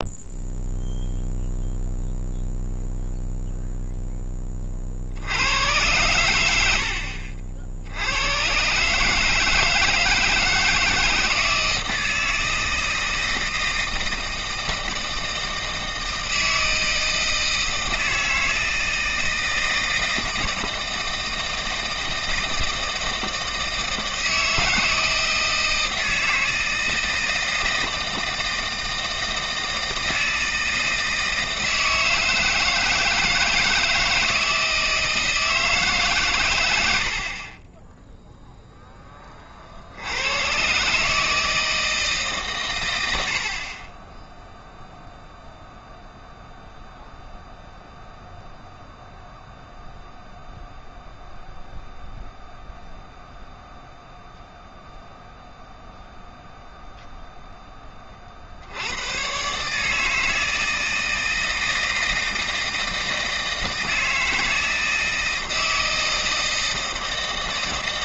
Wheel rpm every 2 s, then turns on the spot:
0, 0, 20, 90, 120, 160, 160, 160, 160, 160, 160, 160, 160, 160, 160, 160, 160, 160, 100, 0, 120, 140, 0, 0, 0, 0, 0, 0, 0, 60, 160, 160, 160, 160.
none